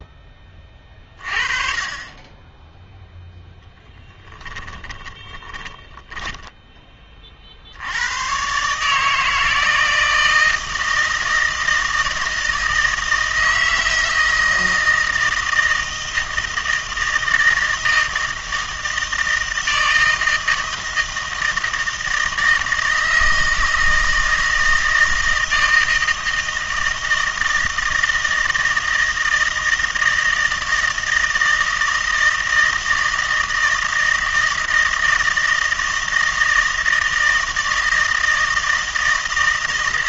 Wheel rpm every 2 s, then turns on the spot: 30, 0, 30, 20, 140, 160, 160, 160, 160, 160, 160, 160, 160, 160, 160, 160, 160, 160, 160, 160.
4-6